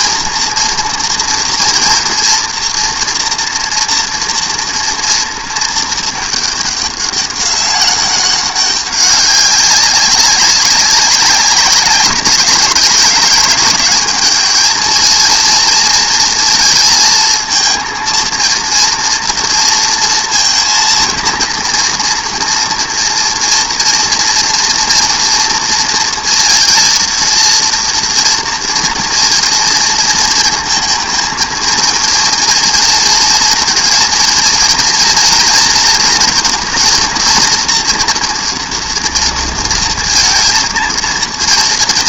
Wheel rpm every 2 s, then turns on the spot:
230, 230, 240, 210, 200, 190, 200, 220, 230, 230, 230, 230, 230, 230, 240, 220, 230, 230, 240, 240, 230.
none